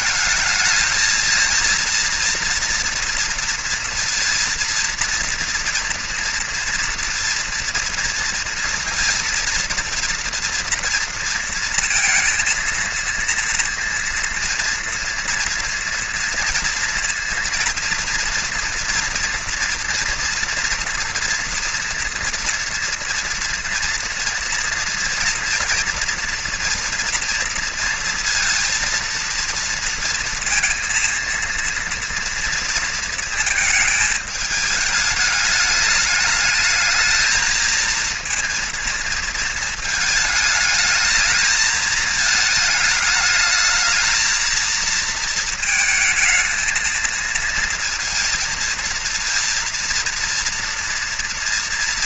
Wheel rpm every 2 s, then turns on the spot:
220, 230, 230, 240, 230, 230, 230, 230, 230, 230, 230, 230, 230, 230, 230, 230, 230, 220, 220, 230, 220, 220, 220, 220, 230, 230.
none